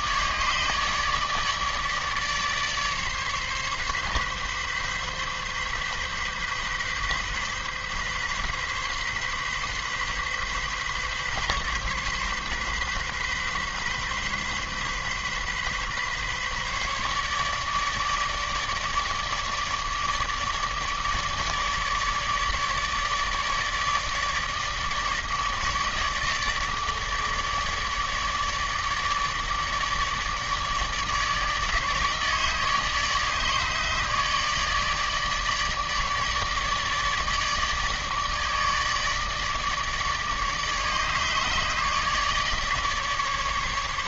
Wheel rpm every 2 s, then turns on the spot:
150, 140, 140, 130, 130, 130, 130, 130, 150, 150, 150, 150, 150, 150, 150, 150, 150, 150, 150, 150, 150, 150.
none